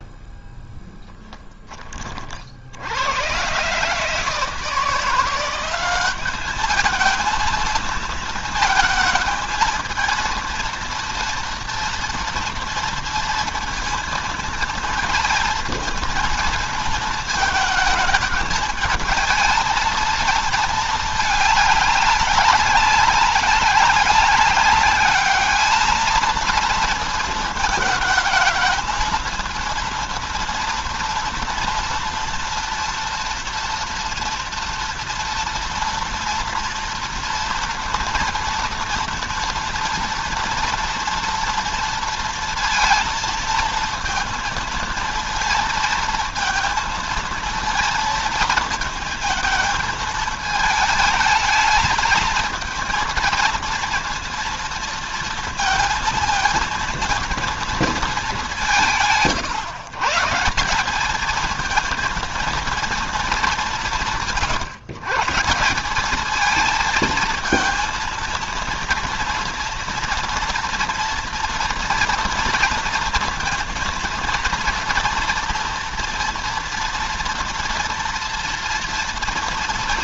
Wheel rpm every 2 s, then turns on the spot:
0, 70, 170, 210, 220, 230, 230, 230, 220, 220, 220, 200, 200, 230, 220, 230, 230, 230, 230, 230, 230, 230, 230, 220, 230, 220, 220, 230, 230, 160, 180, 230, 140, 220, 230, 240, 230, 230, 230, 230.
none